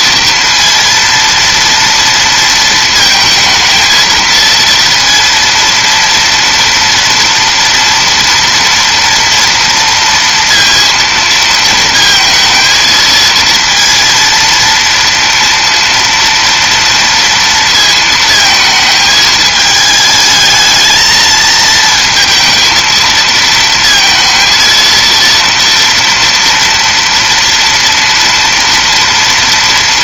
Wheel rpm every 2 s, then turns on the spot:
230, 230, 230, 230, 230, 230, 220, 230, 240, 220, 220, 230, 230, 240, 240.
none